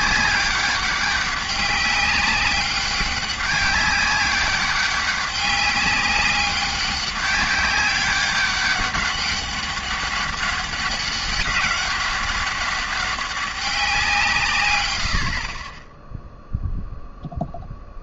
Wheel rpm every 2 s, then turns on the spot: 190, 190, 200, 200, 200, 200, 200, 100, 0.
none